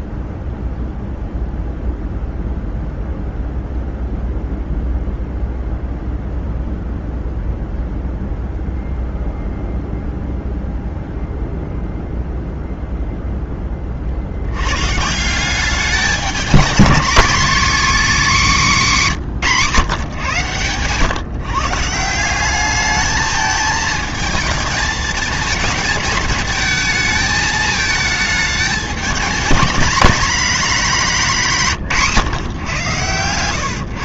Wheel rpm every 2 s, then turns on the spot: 0, 0, 0, 0, 0, 0, 0, 110, 220, 220, 120, 200, 220, 220, 210, 220, 130.
none